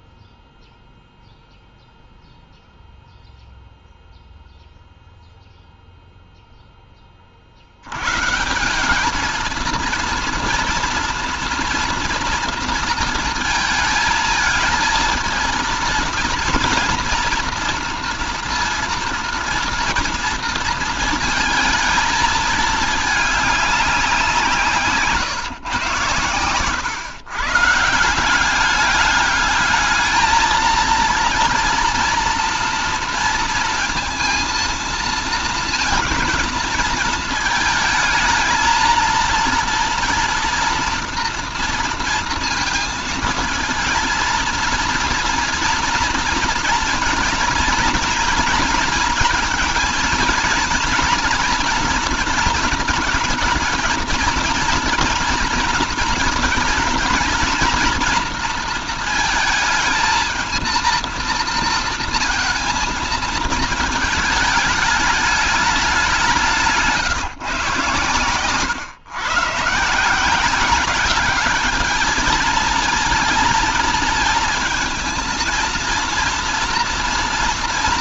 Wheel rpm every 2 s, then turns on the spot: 0, 0, 0, 10, 190, 230, 230, 220, 230, 230, 230, 210, 150, 110, 200, 230, 230, 230, 220, 220, 230, 230, 230, 230, 230, 230, 230, 230, 230, 230, 230, 220, 210, 170, 120, 200, 230, 230, 230.
none